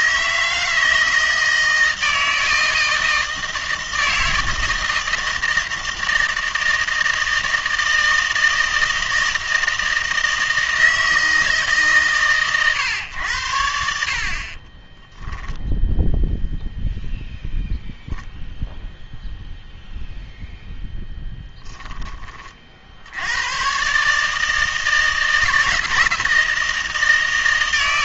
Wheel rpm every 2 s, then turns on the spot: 160, 160, 160, 160, 160, 160, 130, 30, 0, 0, 0, 40, 160, 160.
14-16